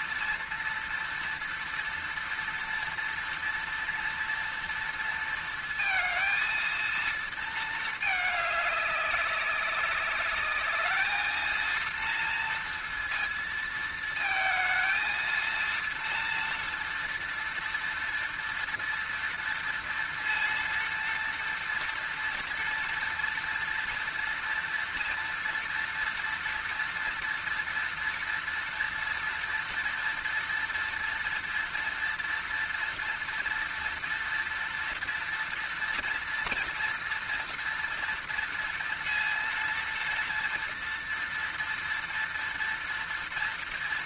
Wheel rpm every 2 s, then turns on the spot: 230, 230, 230, 230, 210, 210, 230, 220, 230, 230, 230, 230, 230, 230, 230, 230, 230, 230, 240, 230, 230, 230.
none